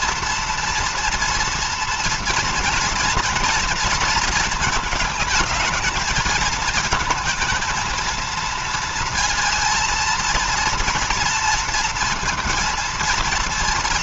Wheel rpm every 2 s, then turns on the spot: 230, 230, 220, 220, 230, 230, 230.
none